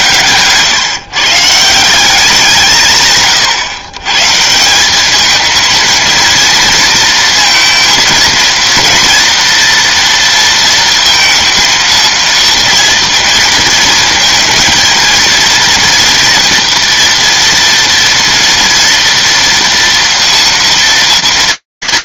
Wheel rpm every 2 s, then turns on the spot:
120, 180, 150, 230, 230, 230, 230, 230, 240, 230, 230.
none